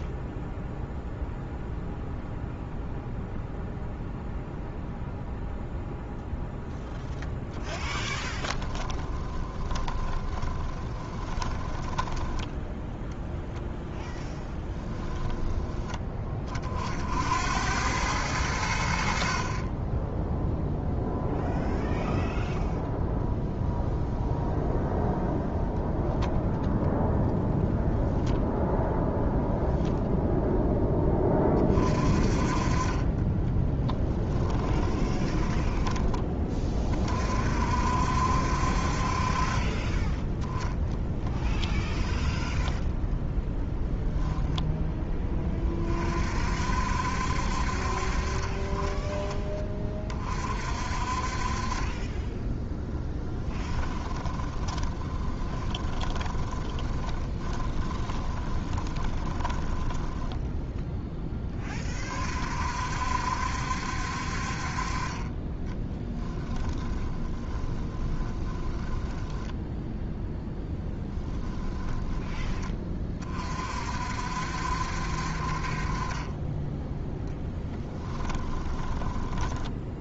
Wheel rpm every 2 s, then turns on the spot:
0, 0, 0, 10, 20, 20, 10, 10, 60, 70, 0, 0, 0, 0, 0, 20, 20, 10, 30, 40, 10, 0, 20, 60, 20, 40, 10, 20, 20, 20, 10, 60, 30, 20, 10, 20, 30, 60, 10, 10.
8-12 14-16 34-36 40-42 52-60 66-72 78-80